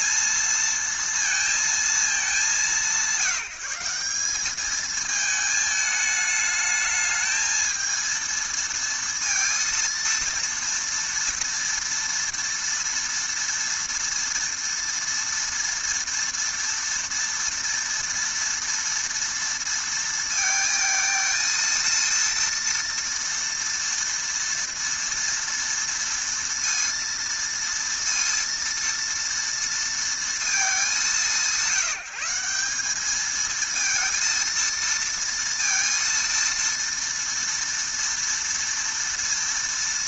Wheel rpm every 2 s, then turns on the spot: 230, 180, 210, 220, 230, 230, 230, 230, 230, 230, 230, 230, 230, 230, 230, 210, 190, 230, 230, 230.
none